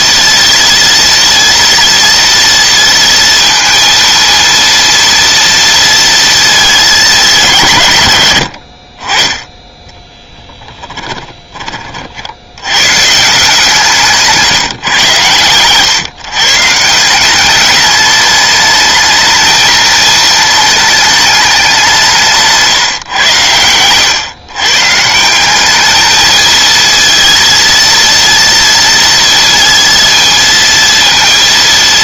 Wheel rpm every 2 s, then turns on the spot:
230, 230, 230, 220, 70, 20, 100, 140, 160, 220, 220, 150, 130, 230, 230, 230.
8-12